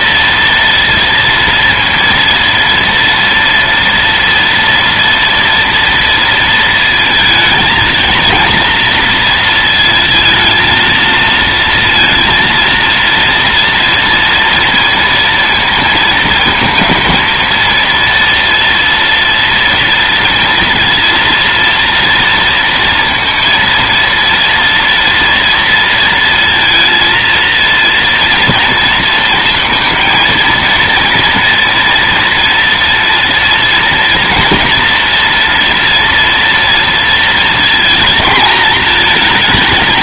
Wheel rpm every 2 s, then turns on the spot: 230, 230, 230, 220, 230, 220, 230, 230, 220, 230, 230, 230, 230, 230, 230, 230, 230, 240, 230, 220.
none